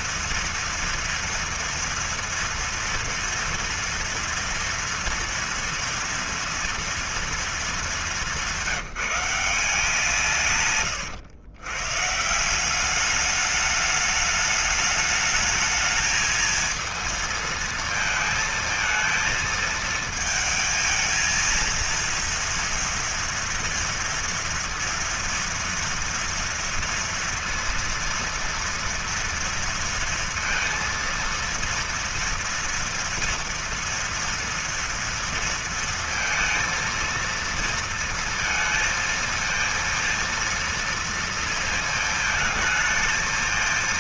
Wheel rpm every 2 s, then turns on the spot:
240, 230, 240, 240, 170, 130, 200, 210, 220, 220, 220, 230, 230, 230, 230, 230, 230, 230, 230, 230, 230, 220.
none